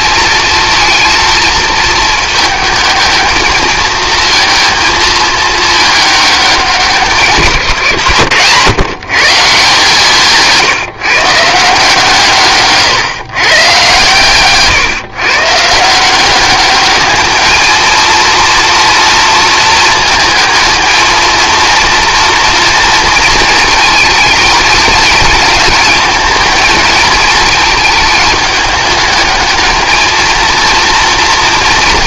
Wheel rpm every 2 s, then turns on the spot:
220, 220, 230, 190, 140, 160, 140, 130, 200, 230, 220, 230, 220, 220, 210, 230.
none